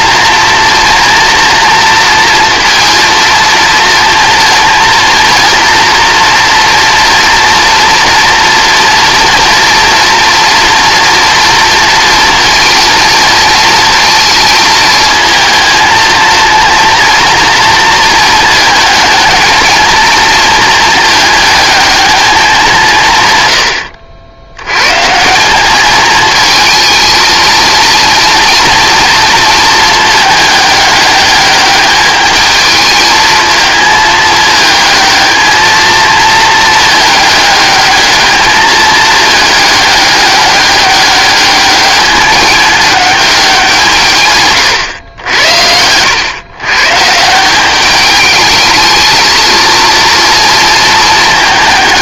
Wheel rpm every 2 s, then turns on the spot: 230, 230, 230, 230, 230, 230, 220, 220, 240, 220, 220, 180, 120, 220, 230, 210, 220, 220, 220, 220, 200, 210, 120, 130, 220, 220.
none